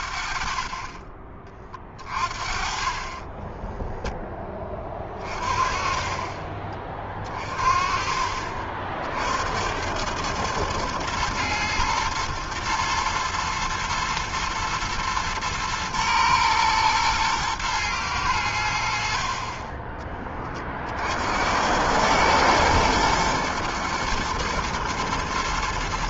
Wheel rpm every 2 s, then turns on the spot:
30, 40, 10, 30, 40, 110, 120, 120, 110, 100, 30, 110, 120.
none